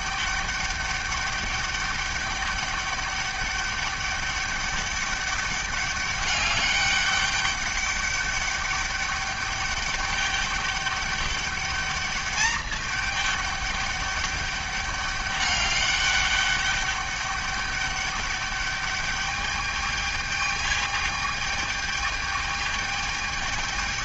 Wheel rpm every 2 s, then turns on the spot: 200, 200, 200, 200, 210, 200, 210, 200, 200, 210, 210, 210.
none